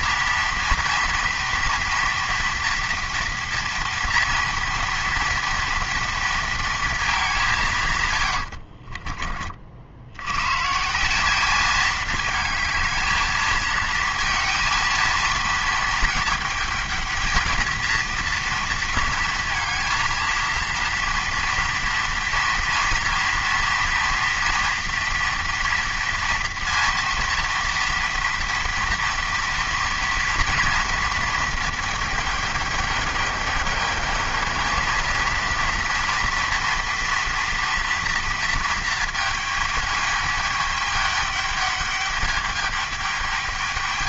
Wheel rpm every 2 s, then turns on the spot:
230, 230, 230, 230, 60, 140, 220, 230, 220, 230, 230, 230, 230, 230, 240, 230, 210, 220, 230, 230, 210, 210.
8-10